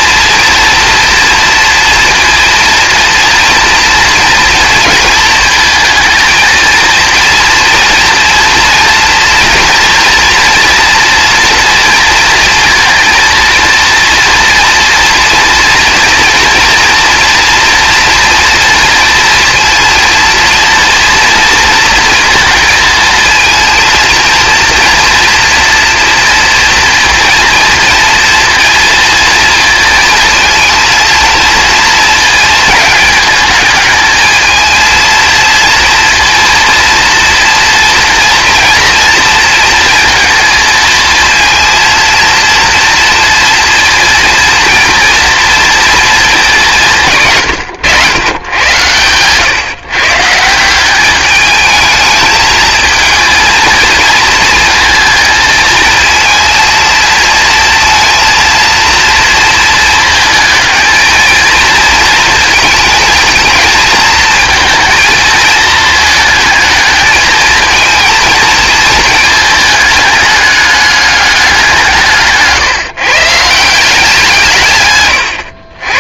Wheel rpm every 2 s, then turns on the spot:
230, 230, 230, 230, 230, 240, 230, 230, 230, 230, 230, 230, 230, 230, 230, 230, 220, 220, 230, 230, 230, 240, 230, 180, 120, 190, 220, 220, 220, 230, 220, 220, 220, 220, 220, 210, 150, 130.
none